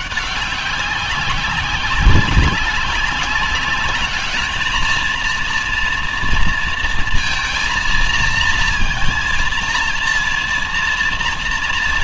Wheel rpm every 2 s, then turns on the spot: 200, 200, 230, 230, 230, 230.
none